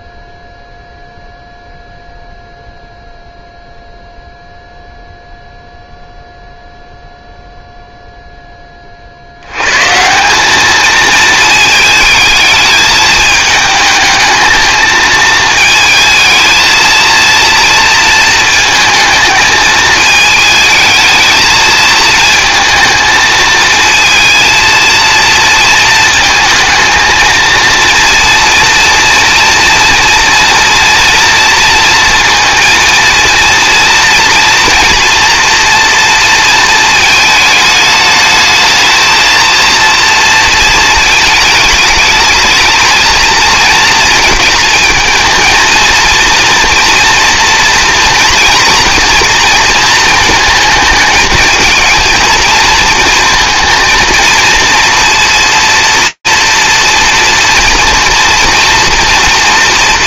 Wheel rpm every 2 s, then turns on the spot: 0, 0, 0, 0, 10, 200, 220, 220, 220, 220, 220, 230, 220, 220, 240, 230, 230, 230, 220, 220, 220, 220, 230, 230, 230, 220, 220, 230, 230, 230.
none